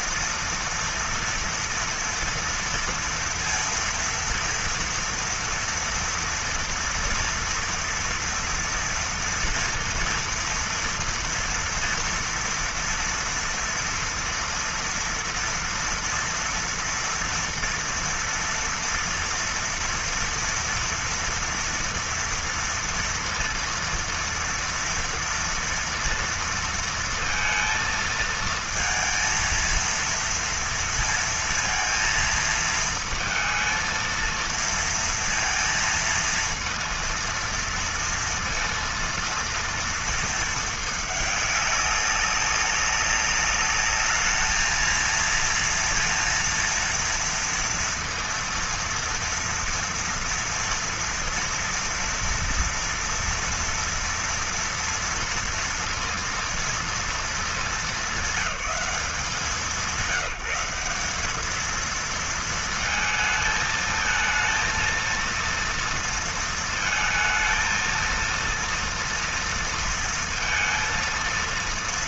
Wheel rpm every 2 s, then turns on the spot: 230, 230, 230, 230, 240, 230, 230, 240, 230, 230, 240, 230, 240, 230, 220, 230, 230, 230, 230, 230, 220, 200, 220, 230, 230, 230, 240, 230, 230, 190, 180, 220, 220, 230, 230, 230.
none